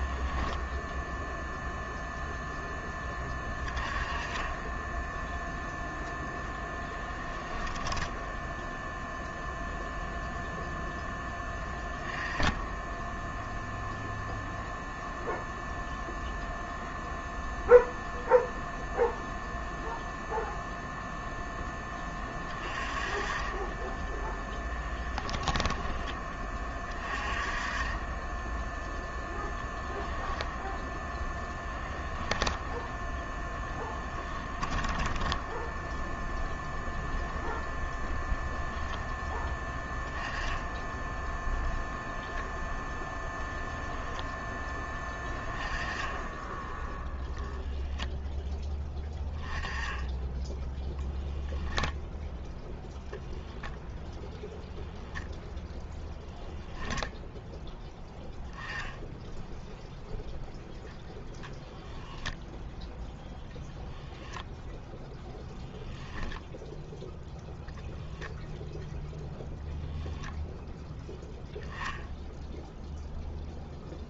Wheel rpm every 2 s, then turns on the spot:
0, 10, 10, 10, 0, 0, 10, 0, 0, 0, 0, 20, 10, 30, 0, 10, 10, 30, 0, 0, 10, 0, 10, 0, 10, 0, 0, 0, 0, 10, 0, 0, 0, 10, 0, 0, 0.
6-8 24-26 34-36